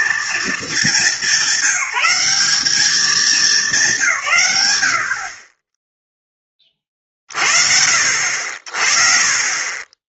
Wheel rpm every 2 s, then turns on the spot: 220, 200, 90, 20, 50.
none